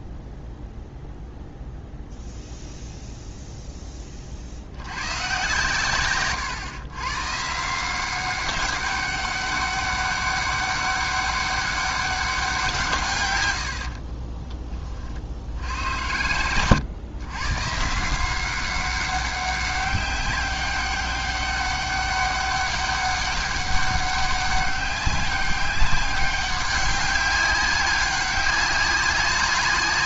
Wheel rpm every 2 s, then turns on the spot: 0, 0, 60, 130, 200, 200, 180, 30, 110, 190, 200, 200, 200, 200, 190.
none